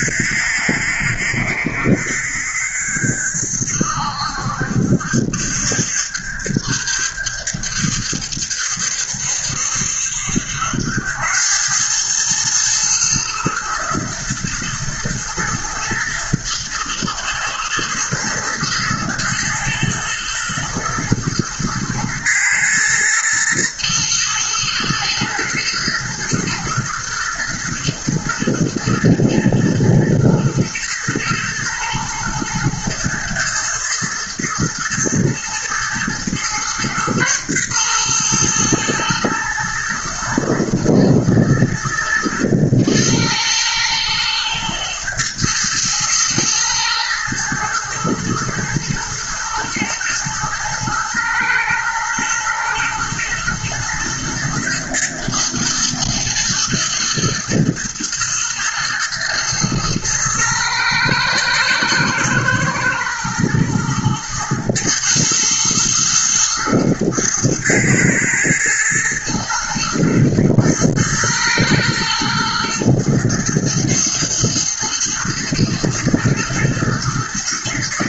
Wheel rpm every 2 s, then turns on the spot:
70, 70, 70, 70, 70, 90, 110, 110, 110, 110, 110, 110, 110, 120, 110, 120, 120, 110, 120, 110, 120, 110, 110, 110, 110, 110, 110, 110, 120, 120, 110, 110, 110, 110, 110, 110, 110, 110, 110.
none